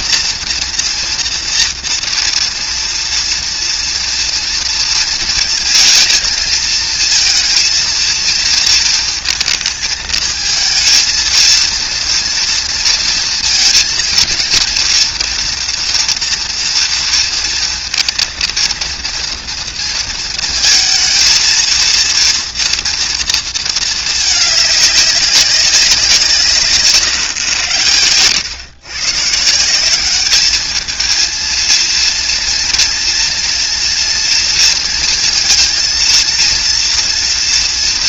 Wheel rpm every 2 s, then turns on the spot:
230, 230, 230, 230, 230, 230, 230, 230, 230, 230, 220, 230, 210, 150, 110, 220, 230, 230, 230.
none